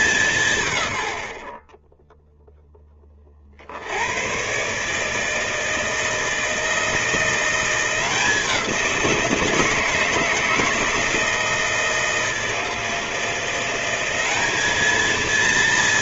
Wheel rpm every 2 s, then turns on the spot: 120, 40, 160, 170, 170, 160, 170, 200.
none